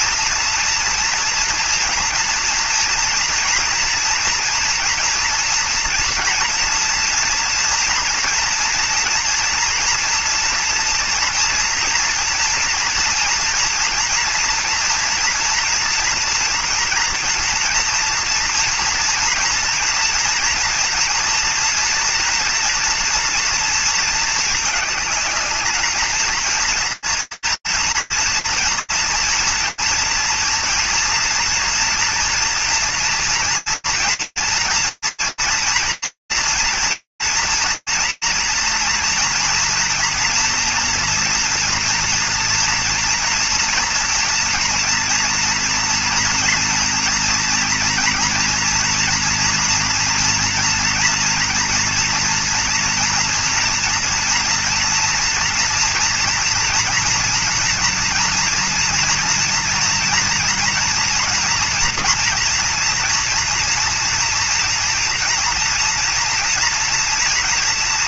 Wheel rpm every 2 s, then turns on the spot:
230, 230, 230, 240, 240, 230, 230, 230, 230, 230, 240, 230, 220, 230, 230, 240, 230, 230, 230, 230, 230, 230, 230, 230, 230, 230, 230, 240, 230, 230, 230, 230, 230, 240.
none